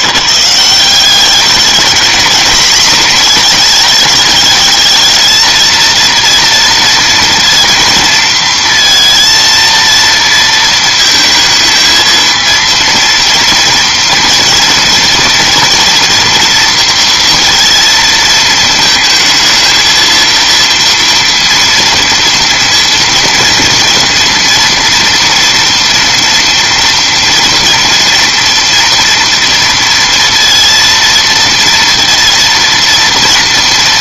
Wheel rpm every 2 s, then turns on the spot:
170, 230, 220, 230, 230, 220, 230, 230, 230, 220, 230, 230, 230, 230, 230, 230, 230.
none